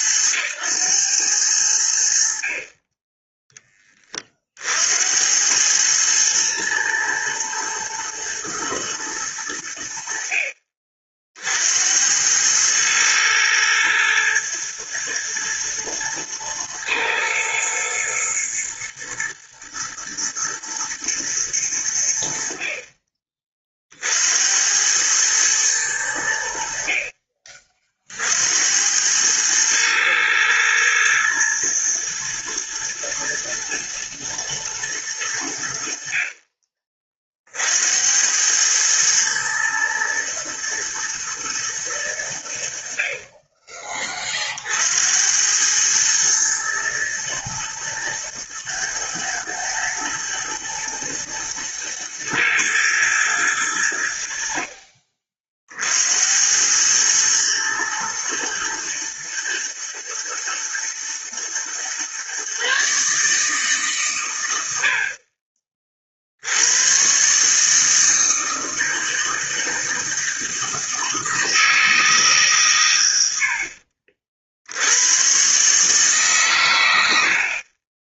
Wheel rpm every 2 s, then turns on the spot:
100, 40, 50, 110, 110, 50, 100, 110, 110, 110, 120, 50, 80, 70, 80, 110, 110, 110, 40, 100, 110, 80, 50, 110, 110, 110, 120, 60, 100, 110, 120, 140, 90, 80, 160, 160, 140, 70, 120.
none